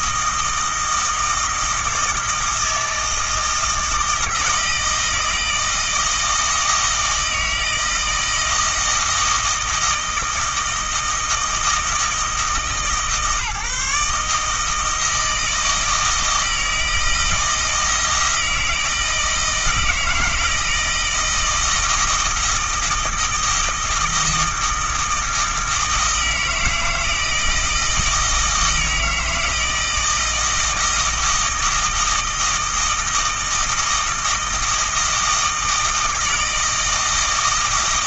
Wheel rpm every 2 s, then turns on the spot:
160, 160, 160, 160, 160, 160, 150, 160, 160, 160, 160, 160, 160, 160, 160, 160, 160, 160, 160.
none